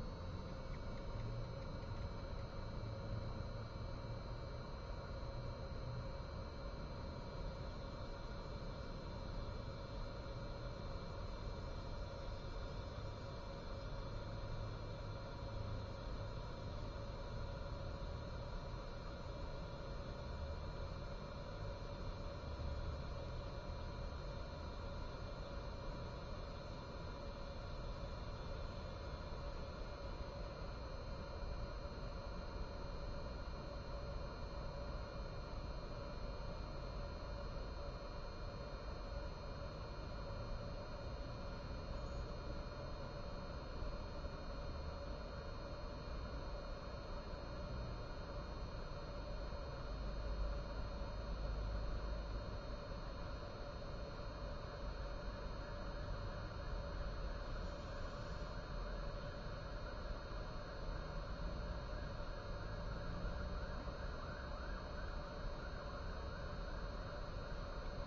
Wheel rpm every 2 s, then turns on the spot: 0, 0, 0, 0, 0, 0, 0, 0, 0, 0, 0, 0, 0, 0, 0, 0, 0, 0, 0, 0, 0, 0, 0, 0, 0, 0, 0, 0, 0, 0, 0, 0, 0, 0.
none